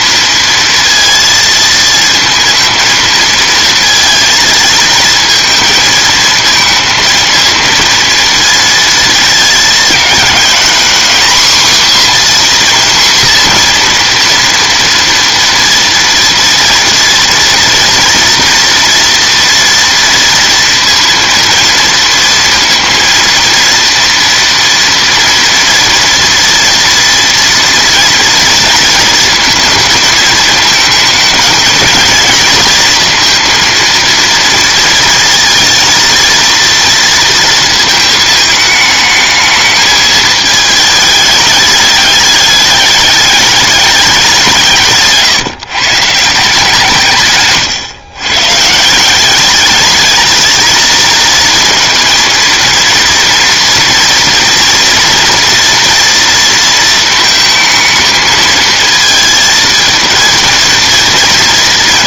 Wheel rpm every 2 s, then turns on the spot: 230, 230, 230, 230, 230, 230, 260, 230, 230, 230, 230, 230, 230, 230, 230, 220, 220, 230, 230, 220, 210, 210, 170, 160, 150, 230, 230, 230, 230, 220, 230.
none